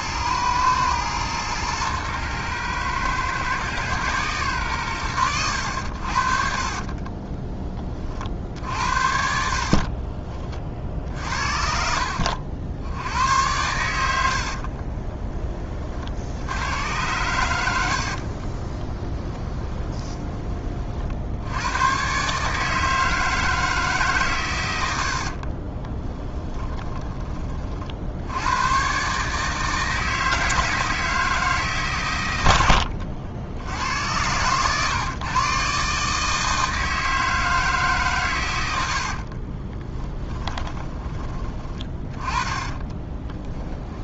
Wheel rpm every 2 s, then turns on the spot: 110, 110, 120, 40, 50, 40, 60, 60, 80, 30, 30, 150, 110, 10, 100, 160, 90, 100, 160, 100, 10, 20.
14-16 18-20 32-34 40-44